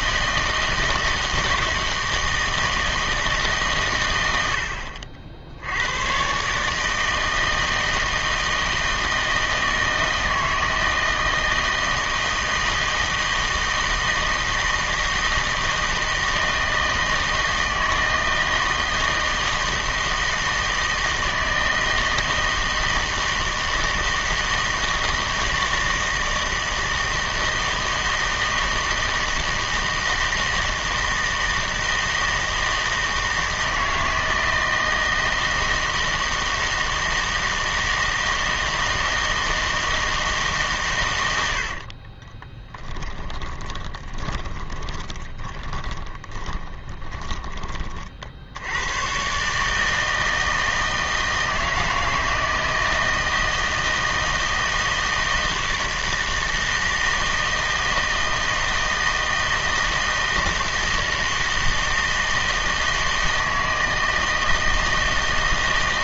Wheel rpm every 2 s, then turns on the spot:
160, 160, 80, 140, 160, 160, 160, 160, 160, 160, 160, 160, 160, 160, 160, 160, 160, 160, 160, 160, 140, 20, 20, 20, 100, 160, 160, 160, 160, 160, 160, 160, 160.
42-48